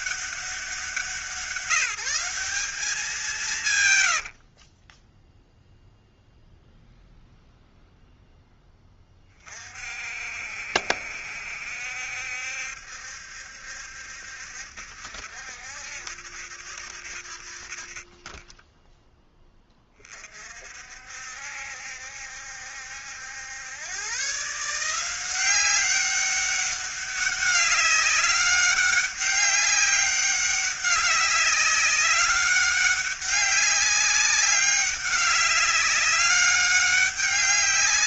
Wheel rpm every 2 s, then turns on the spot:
180, 200, 20, 0, 10, 60, 70, 70, 70, 10, 60, 70, 170, 200, 200, 200, 200, 190, 200.
4-6